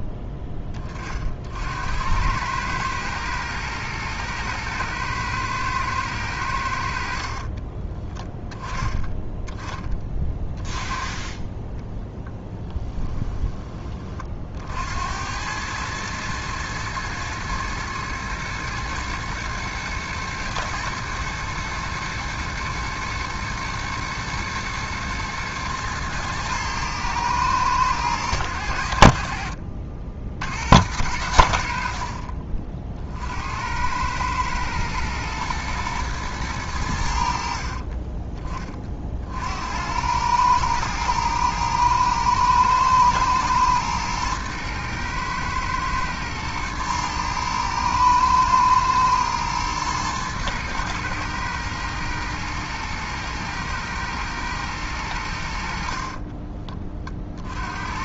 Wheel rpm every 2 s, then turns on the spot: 20, 110, 110, 70, 10, 20, 10, 80, 110, 110, 110, 110, 120, 110, 90, 80, 50, 110, 90, 40, 110, 120, 110, 110, 110, 110, 110, 110, 30.
10-14